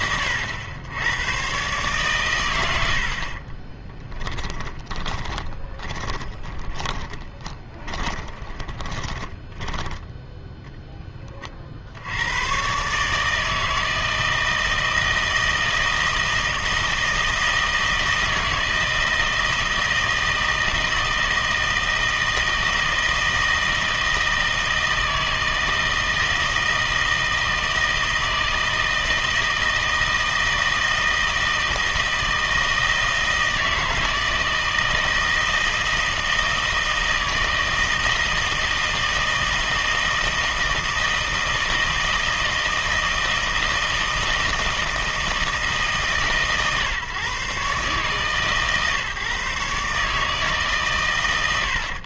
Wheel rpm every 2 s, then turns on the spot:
100, 90, 20, 20, 20, 10, 120, 160, 160, 160, 160, 160, 160, 160, 160, 160, 160, 160, 160, 160, 160, 160, 160, 140, 130, 150.
4-10